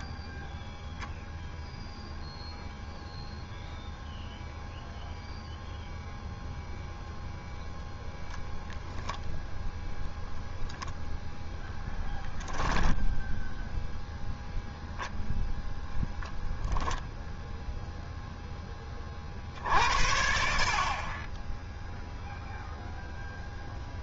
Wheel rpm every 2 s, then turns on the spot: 0, 0, 0, 10, 10, 20, 0, 0, 0, 60, 0, 90.
none